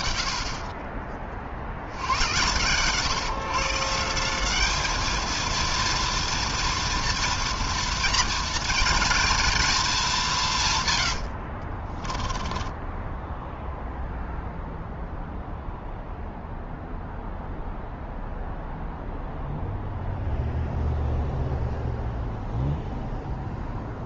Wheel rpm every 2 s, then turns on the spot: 40, 140, 230, 230, 230, 70, 0, 0, 0, 0, 0, 0.
10-12